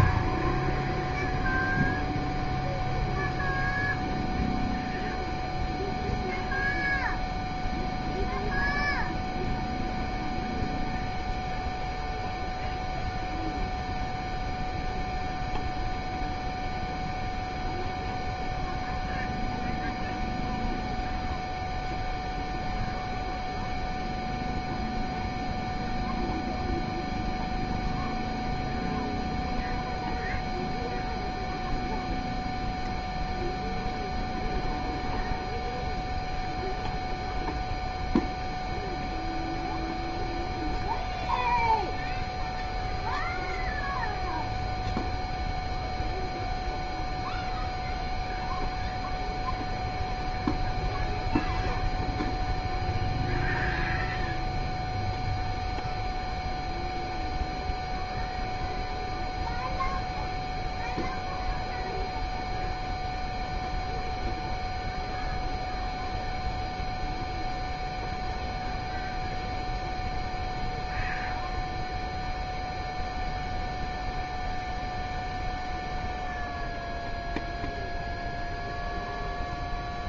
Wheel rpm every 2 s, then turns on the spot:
0, 0, 0, 0, 0, 0, 0, 0, 0, 0, 0, 0, 0, 0, 0, 0, 0, 0, 0, 0, 0, 0, 0, 0, 0, 0, 0, 0, 0, 0, 0, 0, 0, 0, 0, 0, 0, 0, 0, 0.
none